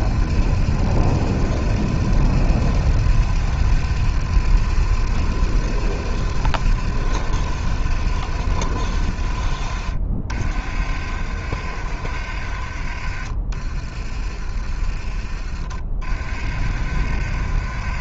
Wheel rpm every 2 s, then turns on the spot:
60, 60, 60, 60, 50, 60, 50, 40, 60.
12-16